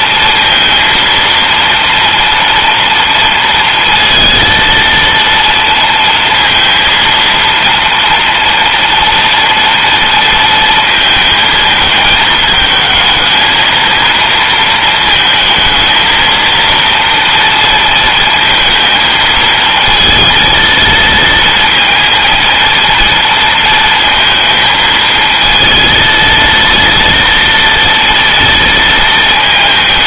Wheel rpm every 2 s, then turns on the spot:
230, 230, 230, 230, 240, 220, 220, 230, 230, 230, 230, 230, 220, 230, 230.
none